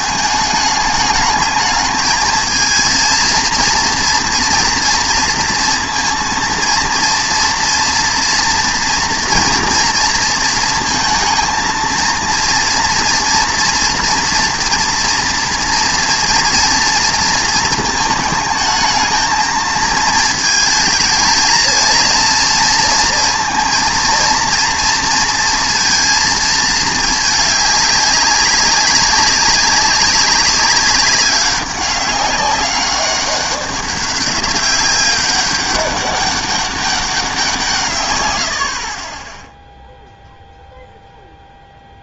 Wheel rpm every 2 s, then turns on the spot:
210, 220, 230, 230, 240, 230, 230, 230, 230, 220, 220, 230, 230, 220, 200, 200, 200, 200, 200, 70, 0.
none